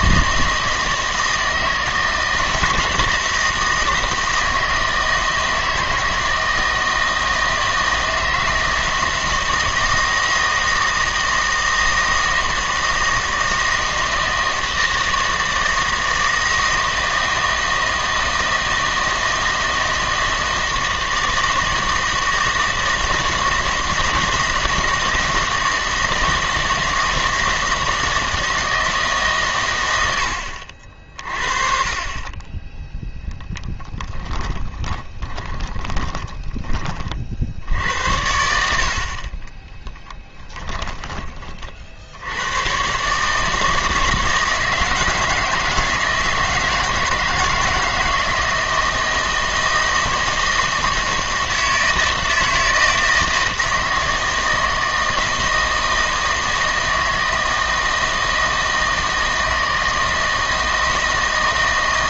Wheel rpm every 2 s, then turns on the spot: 160, 160, 160, 160, 160, 160, 160, 160, 160, 160, 160, 160, 160, 160, 160, 60, 10, 20, 30, 60, 10, 110, 160, 160, 160, 160, 160, 160, 160, 160, 160.
34-36 40-42